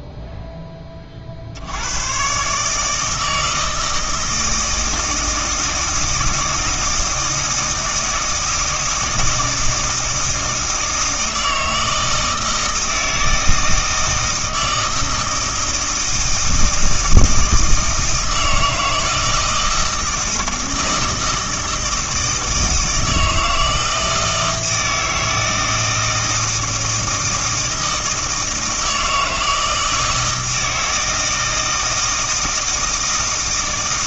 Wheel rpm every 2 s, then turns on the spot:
10, 140, 160, 160, 160, 160, 160, 160, 160, 160, 160, 160, 160, 160, 160, 160, 160.
none